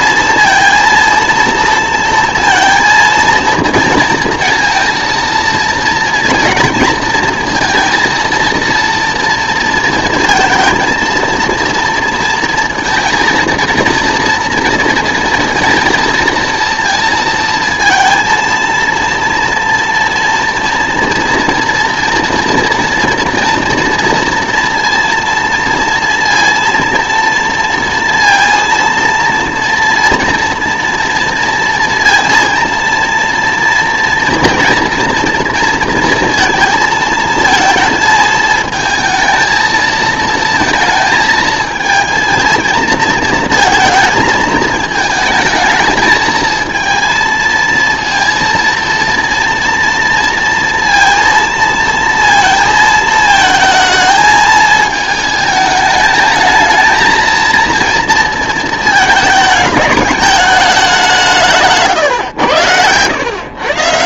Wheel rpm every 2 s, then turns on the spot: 230, 230, 230, 230, 230, 230, 230, 230, 230, 230, 230, 230, 230, 230, 230, 230, 230, 230, 230, 220, 220, 220, 220, 230, 230, 230, 230, 220, 220, 230, 210, 110.
none